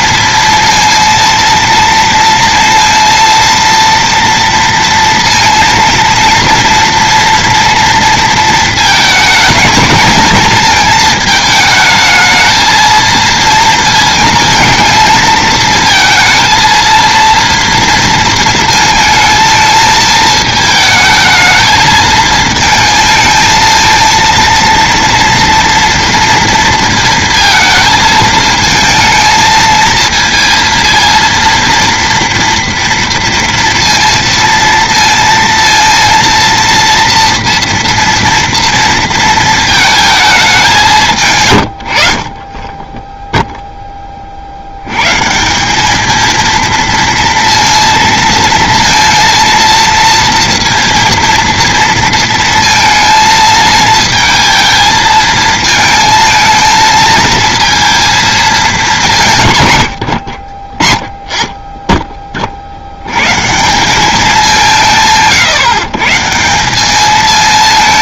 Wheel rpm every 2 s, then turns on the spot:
230, 230, 230, 230, 220, 220, 220, 220, 230, 220, 220, 230, 230, 230, 220, 230, 240, 230, 230, 230, 180, 10, 100, 230, 230, 230, 230, 220, 230, 210, 30, 60, 170, 190.
none